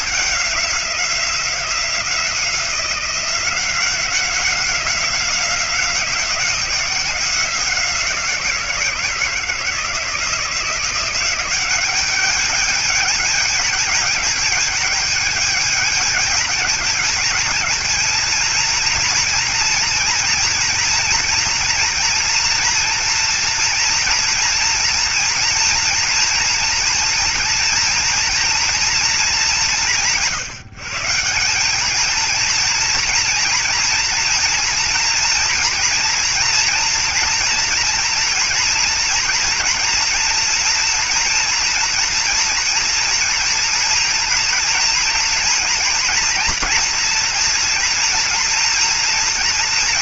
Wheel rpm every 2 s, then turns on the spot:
190, 180, 190, 180, 170, 170, 210, 210, 210, 230, 230, 230, 230, 230, 230, 160, 230, 230, 240, 230, 230, 240, 230, 240, 230.
none